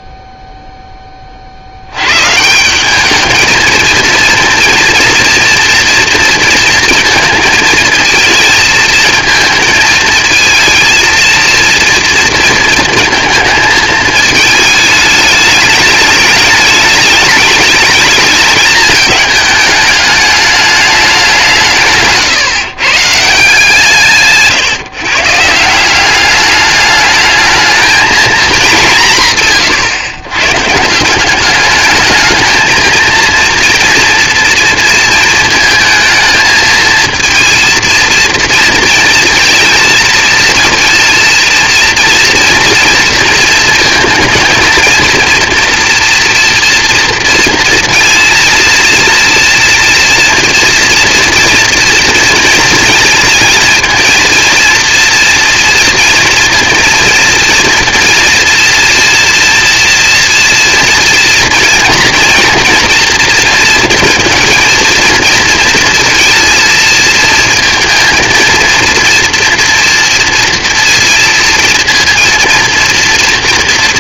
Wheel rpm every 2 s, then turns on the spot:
0, 160, 230, 230, 220, 230, 230, 220, 210, 220, 210, 130, 150, 210, 220, 130, 220, 230, 220, 230, 230, 230, 230, 230, 230, 230, 230, 230, 230, 240, 230, 230, 230, 230, 230, 230, 230.
none